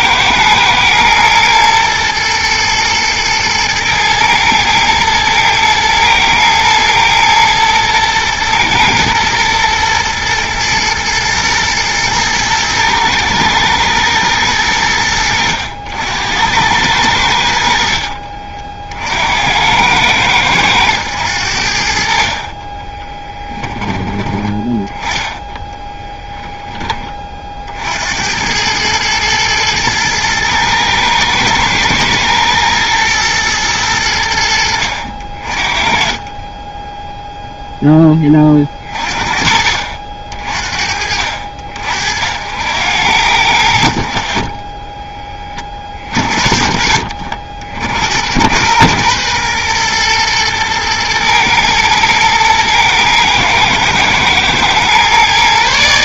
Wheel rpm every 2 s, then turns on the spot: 120, 120, 110, 110, 110, 120, 110, 100, 90, 50, 100, 30, 10, 10, 100, 110, 120, 70, 20, 40, 40, 80, 20, 40, 100, 110, 120, 120.
22-24